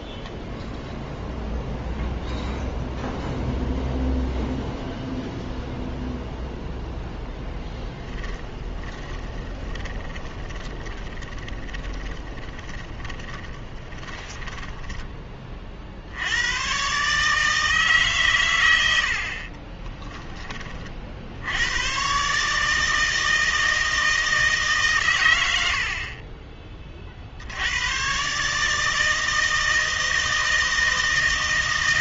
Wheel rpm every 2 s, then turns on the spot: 0, 0, 0, 0, 20, 20, 20, 20, 120, 100, 30, 150, 140, 20, 150, 160.
8-16